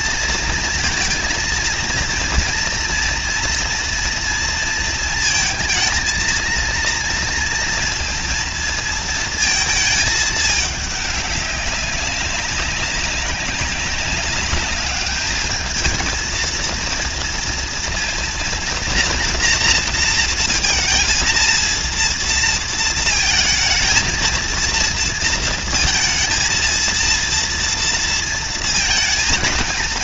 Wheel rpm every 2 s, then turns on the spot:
230, 230, 230, 220, 230, 220, 200, 200, 230, 230, 230, 230, 230, 230, 230.
none